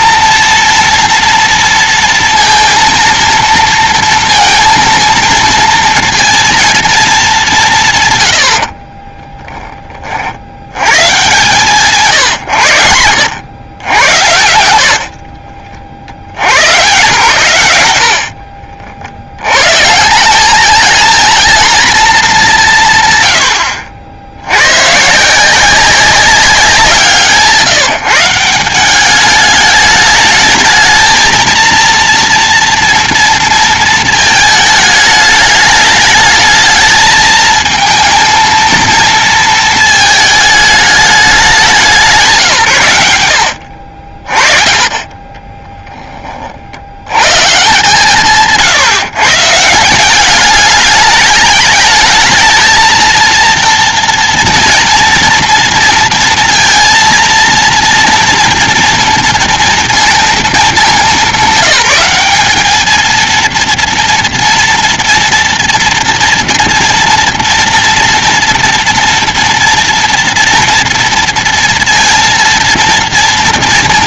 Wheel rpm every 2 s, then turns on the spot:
230, 230, 230, 220, 40, 100, 110, 70, 120, 60, 220, 170, 110, 180, 180, 220, 230, 210, 220, 230, 210, 130, 30, 50, 150, 210, 220, 230, 230, 230, 220, 210, 230, 240, 230, 230, 230.
8-10 48-50